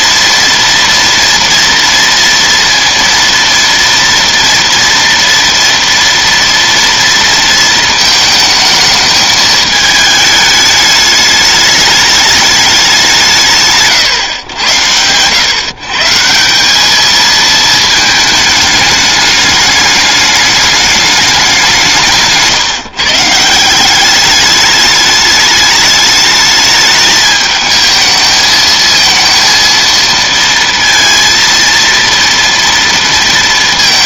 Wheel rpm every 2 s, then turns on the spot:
230, 230, 230, 230, 220, 210, 210, 140, 160, 220, 210, 160, 200, 210, 220, 230, 230.
22-24